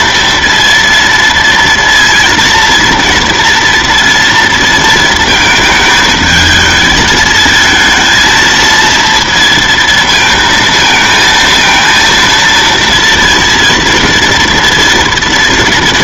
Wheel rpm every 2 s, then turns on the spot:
230, 230, 230, 220, 230, 220, 230, 230.
none